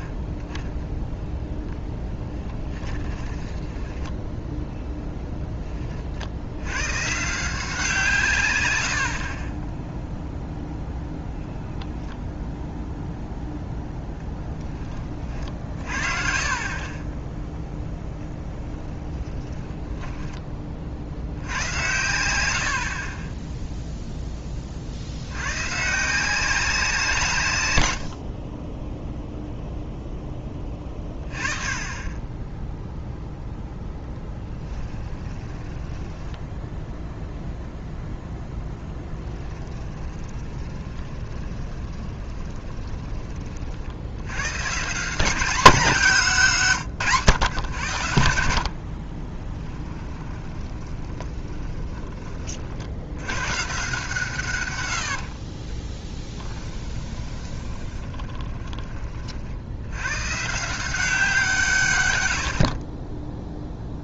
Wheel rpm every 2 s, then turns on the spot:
10, 10, 0, 100, 110, 0, 0, 20, 30, 0, 20, 80, 30, 160, 20, 20, 0, 20, 0, 10, 20, 20, 130, 170, 60, 20, 50, 100, 10, 20, 160, 20.
2-4 34-36 38-44 50-52 54-58